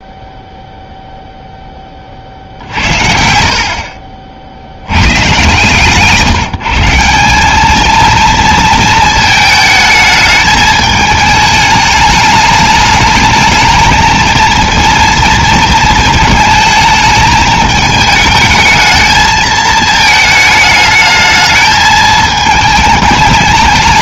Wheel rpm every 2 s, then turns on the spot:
0, 60, 60, 160, 230, 220, 210, 230, 220, 220, 220, 220.
none